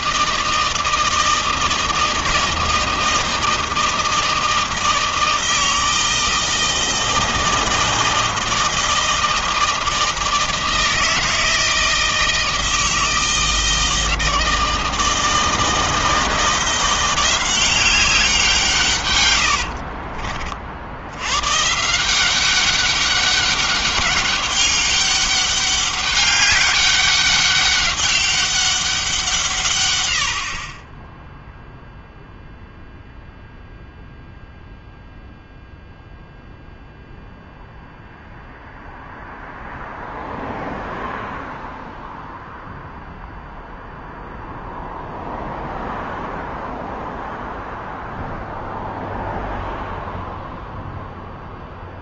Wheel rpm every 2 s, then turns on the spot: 160, 160, 160, 160, 160, 160, 160, 160, 180, 120, 90, 200, 200, 200, 180, 20, 0, 0, 0, 0, 0, 0, 0, 0, 0, 0.
18-20